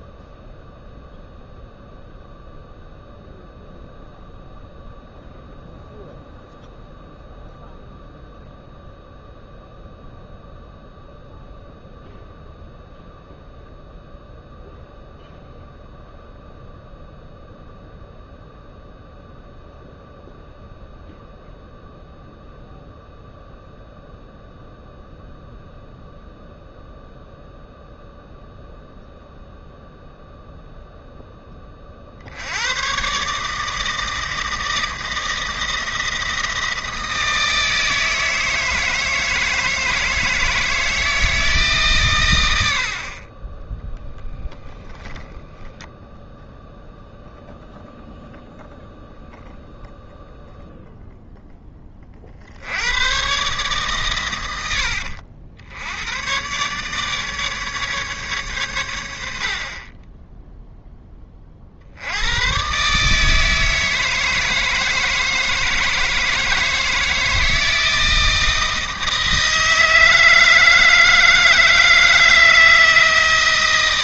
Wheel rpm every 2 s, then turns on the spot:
0, 0, 0, 0, 0, 0, 0, 0, 0, 0, 0, 0, 0, 0, 0, 0, 110, 160, 160, 160, 160, 70, 30, 0, 0, 0, 80, 80, 140, 110, 0, 130, 160, 160, 160, 160, 160.
44-46 54-56